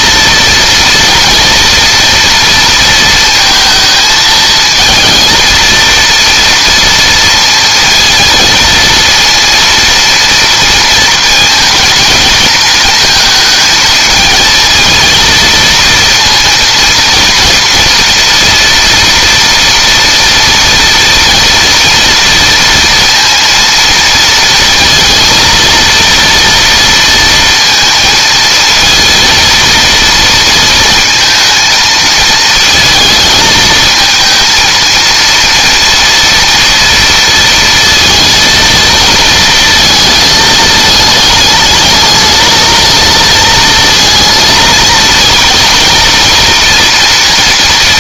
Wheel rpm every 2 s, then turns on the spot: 230, 230, 230, 230, 230, 230, 230, 230, 230, 230, 230, 230, 230, 230, 230, 230, 220, 230, 230, 230, 220, 220, 230, 230.
none